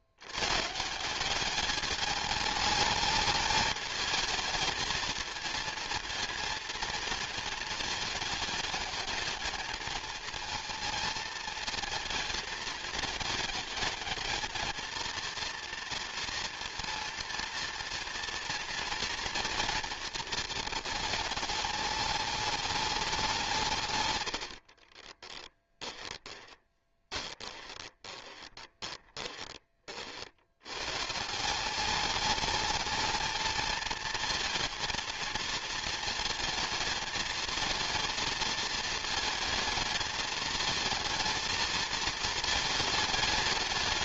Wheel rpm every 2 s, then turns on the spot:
150, 220, 220, 230, 210, 230, 220, 230, 230, 230, 220, 210, 60, 20, 20, 110, 220, 230, 230, 230, 220, 220.
24-30